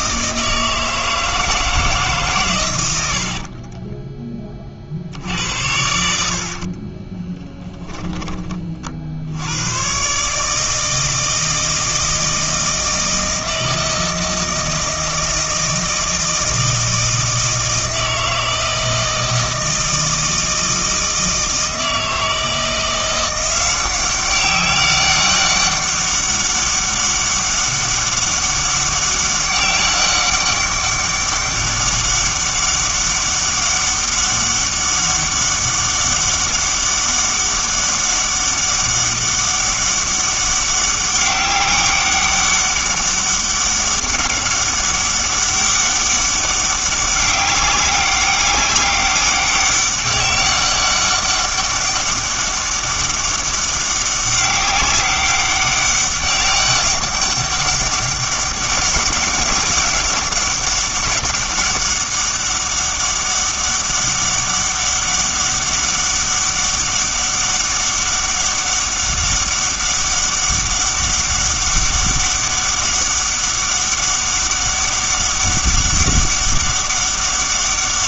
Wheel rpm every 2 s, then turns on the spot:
160, 110, 40, 40, 40, 160, 160, 160, 160, 160, 160, 170, 190, 200, 200, 200, 200, 200, 200, 200, 200, 200, 200, 200, 200, 200, 200, 200, 200, 200, 200, 200, 200, 200, 200, 200, 200, 200, 200.
6-8